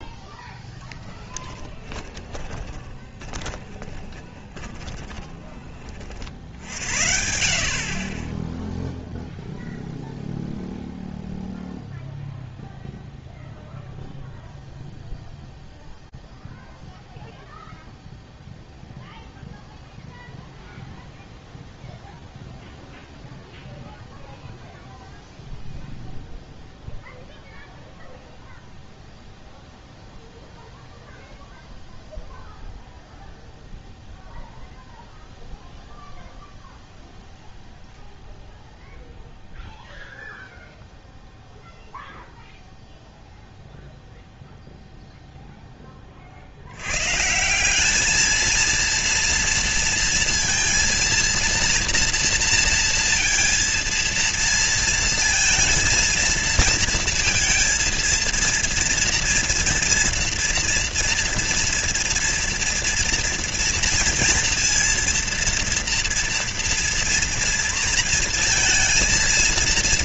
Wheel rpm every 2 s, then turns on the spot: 0, 20, 20, 70, 10, 0, 0, 0, 0, 0, 0, 0, 0, 0, 0, 0, 0, 0, 0, 0, 0, 0, 0, 120, 230, 230, 230, 230, 230, 230, 230, 230, 230, 230, 220.
2-6 8-10